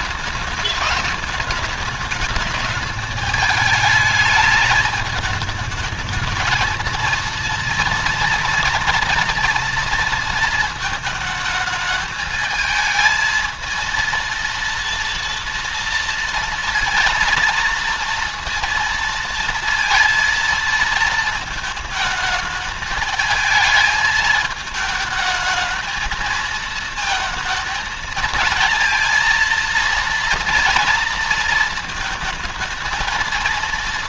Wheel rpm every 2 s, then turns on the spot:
210, 210, 210, 220, 230, 220, 220, 230, 230, 230, 230, 220, 220, 230, 230, 230, 230.
none